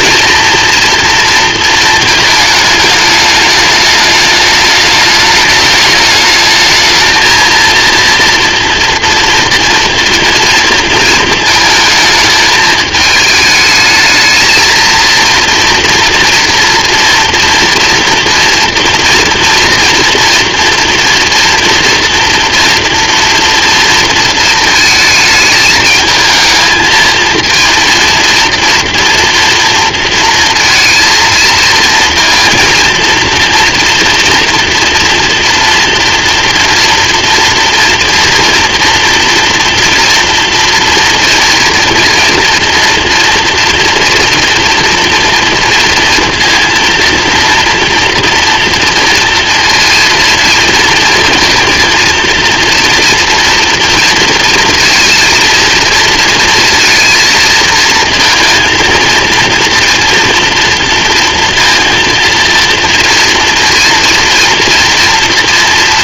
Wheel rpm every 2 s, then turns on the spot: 230, 210, 210, 220, 230, 230, 220, 230, 230, 230, 230, 240, 220, 220, 230, 220, 230, 230, 230, 240, 230, 230, 230, 230, 230, 230, 240, 230, 230, 230, 230, 230, 230.
none